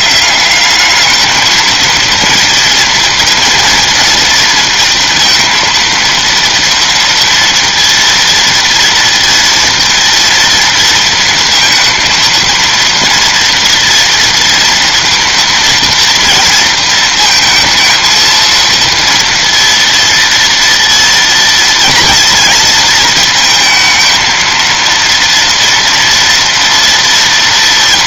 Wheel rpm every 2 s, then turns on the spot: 200, 230, 230, 230, 230, 230, 230, 230, 230, 230, 230, 230, 230, 230.
none